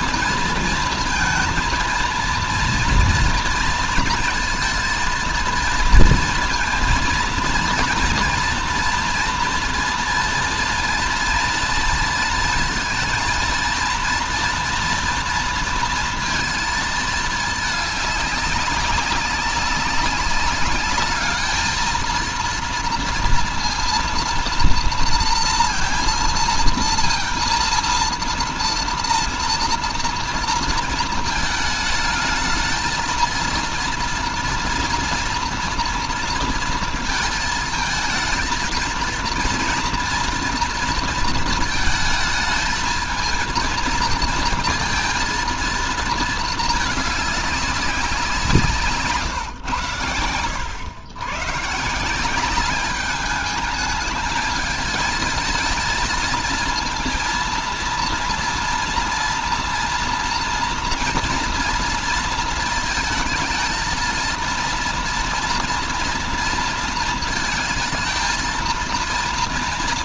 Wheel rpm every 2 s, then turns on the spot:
230, 230, 230, 230, 240, 230, 220, 230, 220, 200, 210, 230, 230, 230, 230, 230, 220, 230, 230, 220, 230, 220, 230, 220, 150, 110, 200, 220, 230, 230, 230, 230, 240, 230, 230.
none